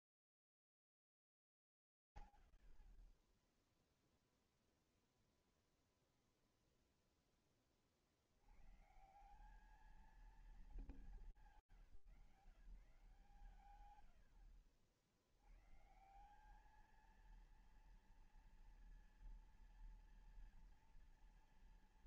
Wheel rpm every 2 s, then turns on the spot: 10, 130, 20, 0, 90, 220, 160, 80, 210, 230, 230.
4-6